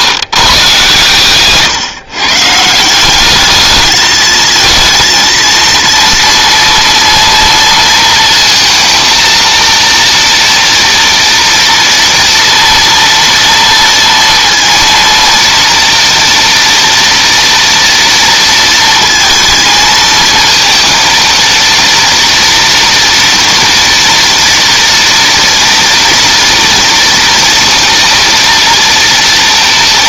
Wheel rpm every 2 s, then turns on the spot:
130, 170, 230, 230, 230, 230, 230, 230, 230, 230, 230, 230, 230, 230, 230.
none